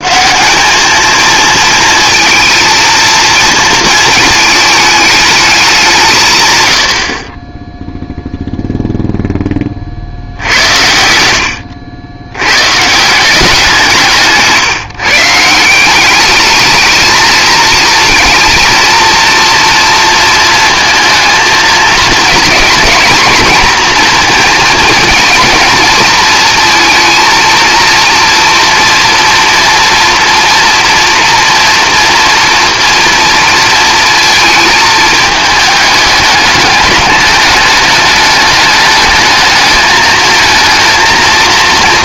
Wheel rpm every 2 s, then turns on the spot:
210, 230, 210, 90, 0, 70, 130, 150, 210, 230, 230, 220, 230, 230, 230, 230, 230, 220, 210, 210, 230.
none